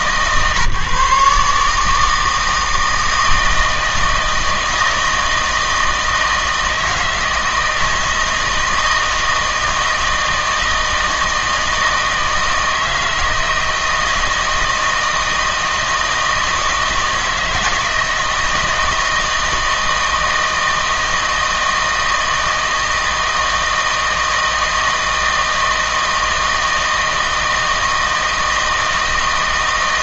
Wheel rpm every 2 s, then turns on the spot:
150, 160, 160, 160, 160, 160, 160, 160, 160, 160, 160, 160, 160, 160, 160.
none